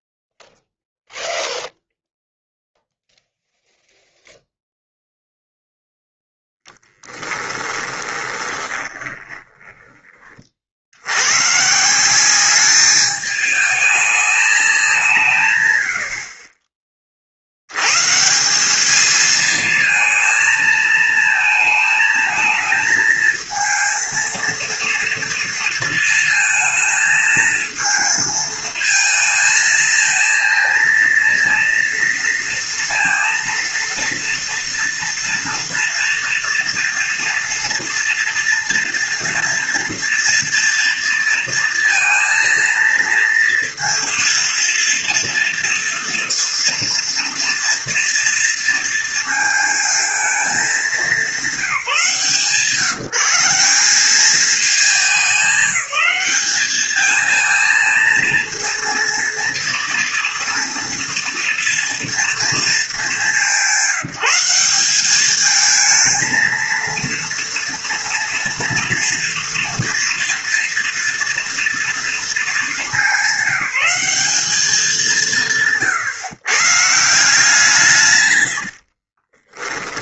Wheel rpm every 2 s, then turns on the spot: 0, 0, 0, 10, 20, 70, 210, 200, 30, 200, 220, 220, 230, 220, 220, 230, 230, 230, 230, 230, 230, 230, 230, 240, 230, 210, 150, 200, 220, 230, 230, 200, 190, 230, 230, 230, 220, 200, 150, 60.
6-10 78-80